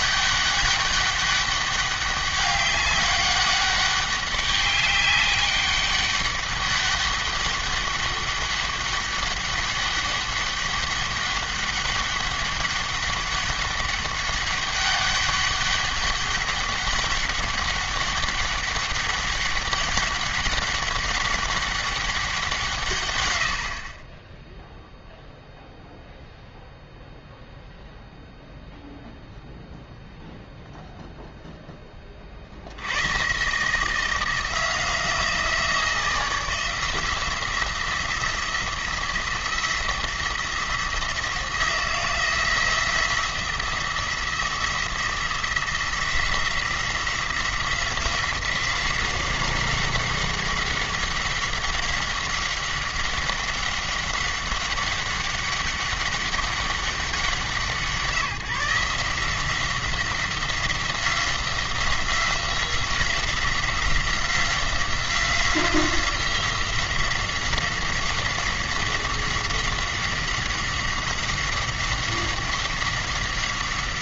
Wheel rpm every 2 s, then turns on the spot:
200, 200, 200, 200, 200, 200, 200, 200, 200, 200, 200, 140, 0, 0, 0, 0, 80, 170, 170, 170, 170, 170, 170, 180, 180, 190, 190, 200, 200, 170, 180, 180, 180, 180, 190, 190, 190.
none